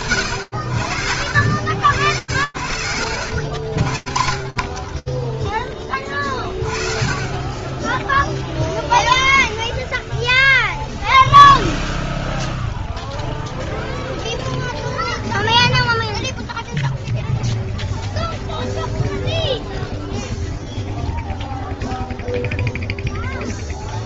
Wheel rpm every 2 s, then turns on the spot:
80, 100, 20, 10, 0, 0, 0, 0, 0, 0, 0, 0.
none